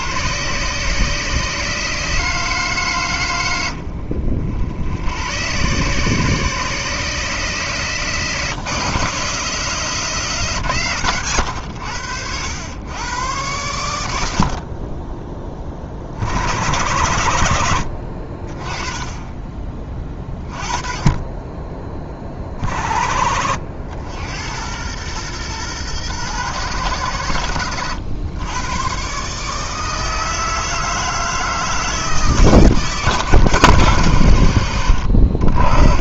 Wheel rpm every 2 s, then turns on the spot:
150, 150, 70, 160, 150, 130, 100, 40, 100, 30, 20, 60, 100, 110, 120, 160, 150, 90.
none